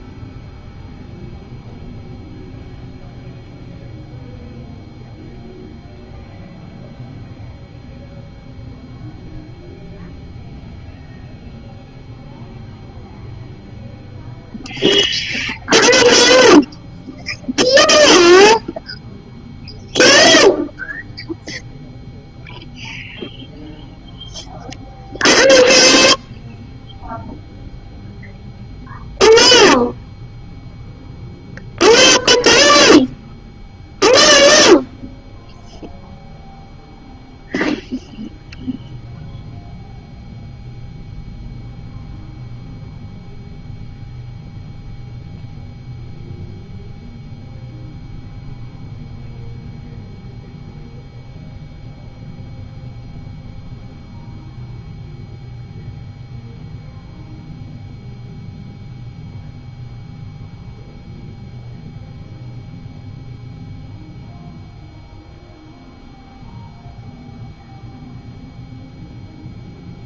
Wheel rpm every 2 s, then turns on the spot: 0, 0, 0, 0, 0, 0, 0, 0, 0, 0, 0, 0, 0, 0, 0, 0, 0, 0, 0, 0, 0, 0, 0, 0, 0, 0, 0, 0, 0, 0, 0, 0, 0, 0, 0.
none